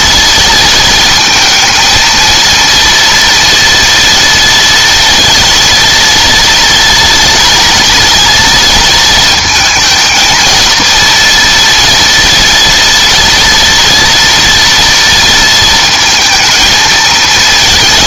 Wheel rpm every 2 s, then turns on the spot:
230, 230, 230, 230, 230, 220, 230, 230, 220.
none